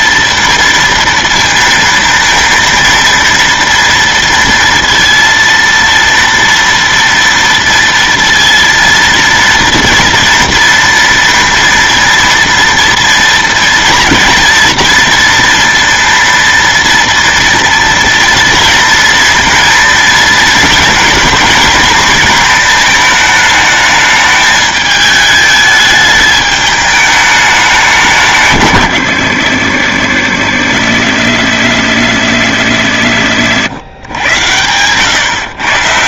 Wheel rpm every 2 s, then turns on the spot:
230, 230, 230, 230, 230, 230, 230, 230, 230, 230, 230, 220, 210, 210, 170, 80, 80, 100.
none